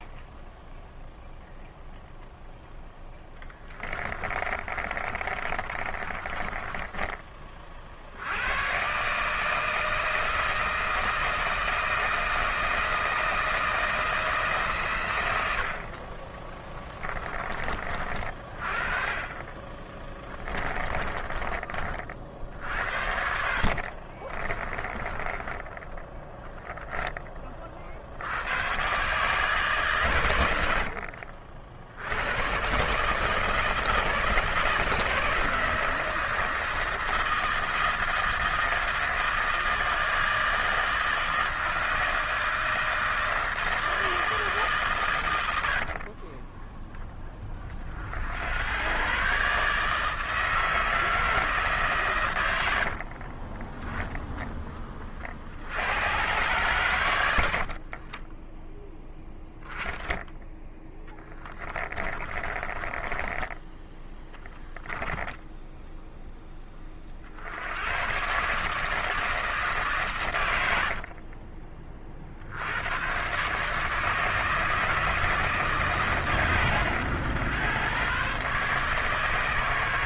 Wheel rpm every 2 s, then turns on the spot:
0, 0, 30, 20, 130, 160, 160, 130, 20, 30, 30, 60, 20, 10, 110, 70, 140, 160, 160, 160, 160, 160, 140, 10, 110, 160, 60, 20, 110, 10, 10, 20, 10, 30, 150, 70, 100, 160, 120, 140.
4-8 16-18 20-22 52-54 62-64 70-72